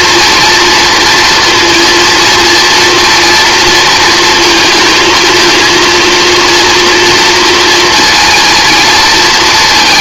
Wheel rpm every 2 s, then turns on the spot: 230, 240, 230, 230, 230.
none